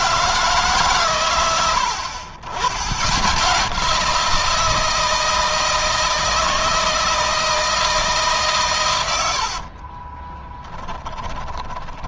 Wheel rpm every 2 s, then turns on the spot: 150, 70, 170, 160, 140, 20.
10-12